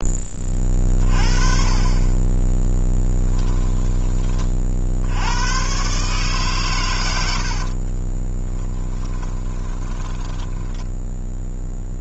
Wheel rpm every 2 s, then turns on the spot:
30, 10, 50, 120, 20, 10.
8-12